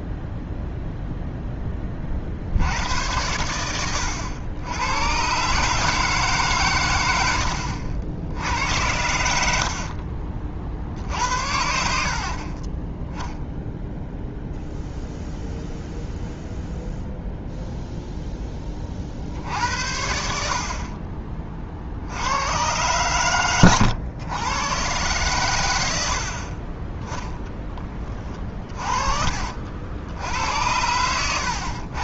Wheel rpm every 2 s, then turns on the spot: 0, 80, 100, 130, 90, 50, 40, 0, 0, 20, 50, 110, 110, 20, 30, 90.
12-14